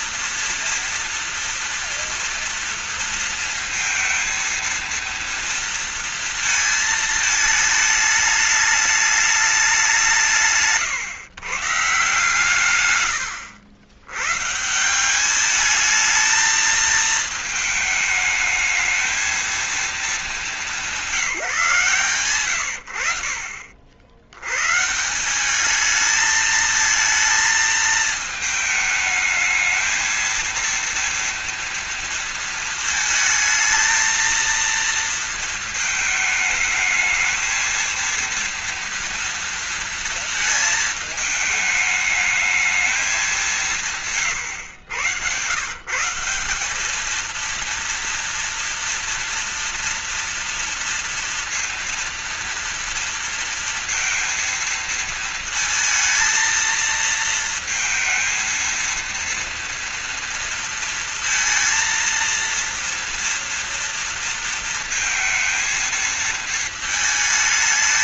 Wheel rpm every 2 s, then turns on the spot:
230, 230, 230, 220, 210, 130, 100, 190, 220, 220, 190, 70, 150, 220, 220, 230, 220, 230, 220, 230, 220, 210, 110, 220, 230, 230, 230, 230, 220, 230, 230, 230, 230, 220.
none